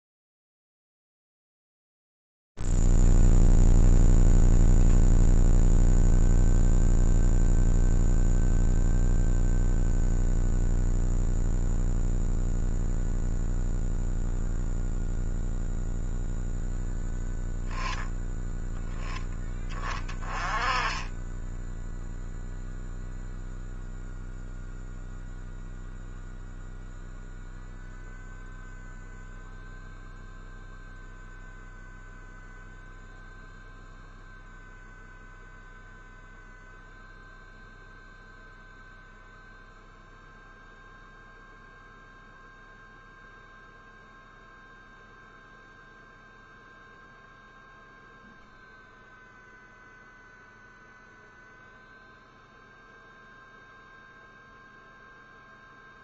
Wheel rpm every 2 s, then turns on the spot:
0, 0, 0, 0, 0, 0, 0, 0, 0, 10, 10, 0, 0, 0, 0, 0, 0, 0, 0, 0, 0, 0, 0, 0, 0, 0, 0, 0.
none